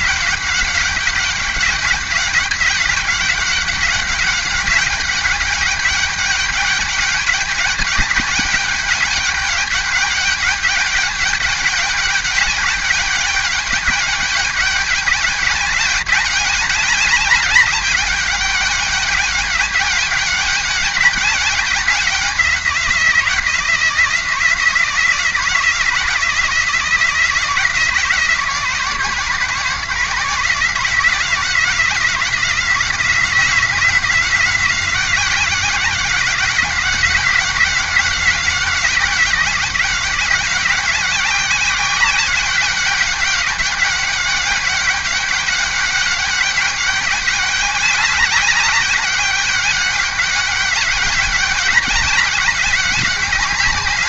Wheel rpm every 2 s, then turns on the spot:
190, 200, 200, 200, 200, 200, 200, 200, 200, 200, 200, 190, 170, 170, 170, 170, 180, 180, 180, 190, 190, 200, 200, 200, 200, 200, 200.
none